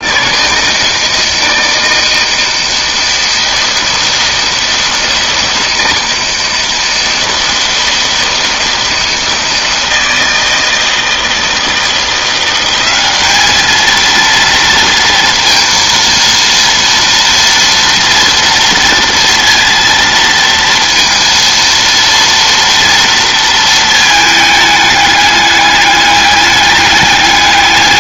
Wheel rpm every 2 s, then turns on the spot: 160, 160, 160, 160, 160, 160, 200, 230, 230, 230, 230, 230, 210, 210.
none